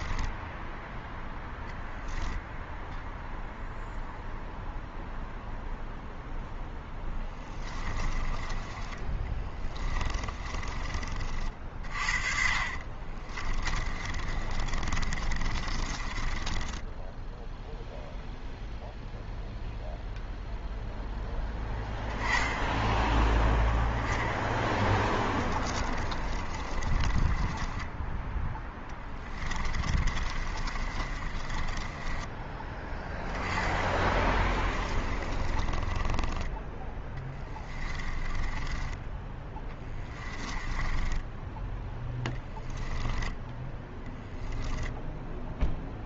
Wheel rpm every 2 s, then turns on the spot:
10, 0, 0, 0, 20, 30, 40, 30, 20, 0, 0, 10, 10, 40, 10, 30, 10, 30, 20, 20, 20, 10, 0.
0-2 8-18 26-32 34-36 38-44